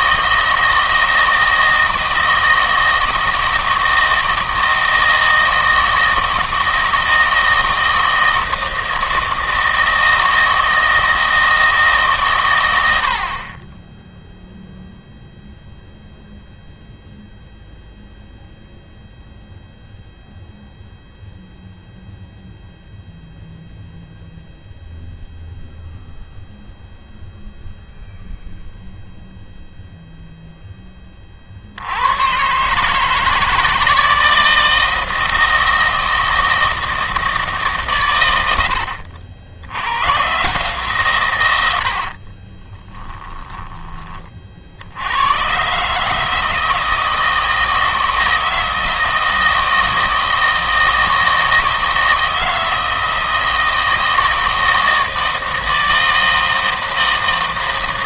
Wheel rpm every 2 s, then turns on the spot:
160, 160, 160, 160, 160, 160, 100, 0, 0, 0, 0, 0, 0, 0, 0, 10, 140, 160, 160, 90, 150, 20, 60, 160, 160, 160, 160, 160, 160.
42-44